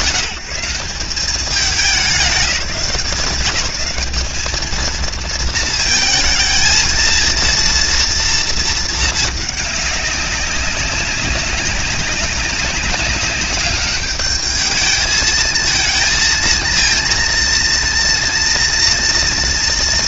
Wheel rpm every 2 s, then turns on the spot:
160, 160, 230, 230, 220, 190, 200, 210, 230, 240.
none